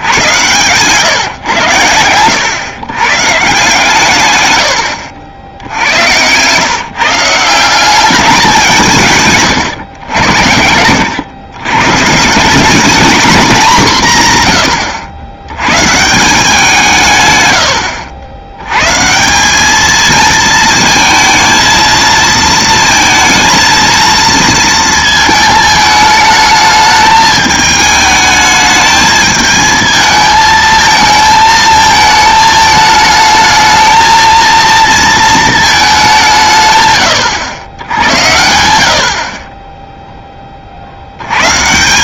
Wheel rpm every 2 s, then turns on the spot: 120, 120, 100, 140, 160, 80, 210, 110, 180, 110, 220, 230, 230, 220, 220, 220, 220, 230, 140, 80, 40.
none